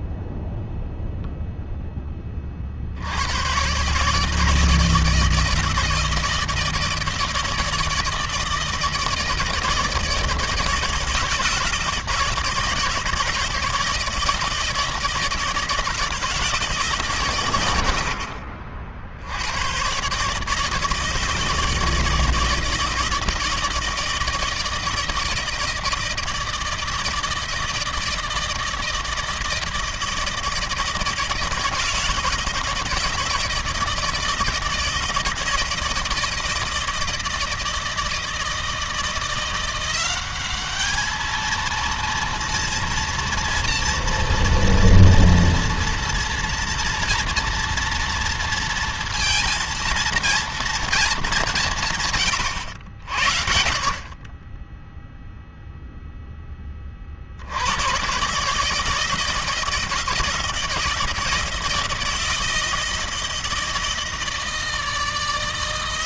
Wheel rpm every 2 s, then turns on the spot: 0, 100, 160, 160, 160, 160, 160, 160, 120, 90, 160, 160, 160, 160, 160, 160, 160, 160, 160, 160, 210, 230, 230, 230, 230, 230, 110, 10, 10, 150, 160, 160, 160.
none